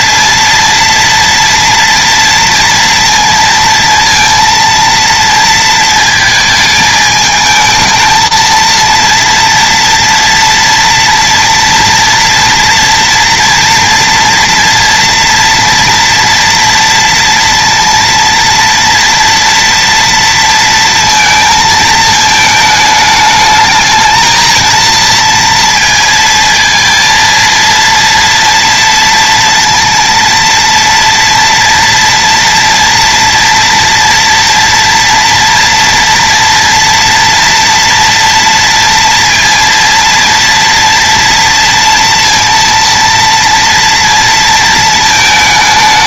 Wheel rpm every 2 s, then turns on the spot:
230, 230, 230, 220, 230, 230, 230, 230, 230, 230, 230, 210, 230, 230, 230, 230, 240, 230, 230, 230, 240, 230, 220.
none